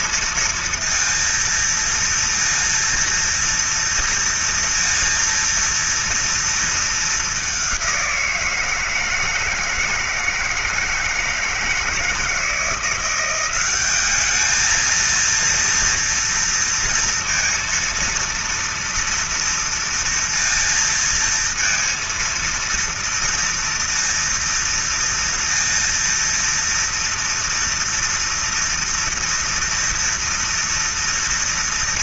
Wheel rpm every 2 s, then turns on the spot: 230, 230, 230, 230, 180, 160, 160, 200, 230, 230, 230, 230, 230, 230, 230, 240.
none